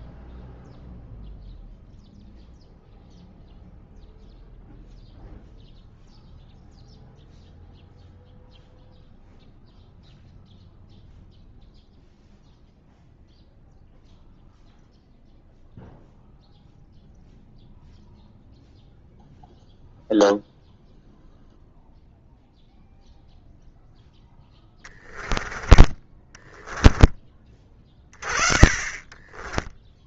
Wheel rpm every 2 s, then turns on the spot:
0, 0, 0, 0, 0, 0, 0, 0, 0, 0, 0, 0, 10, 10, 30.
24-30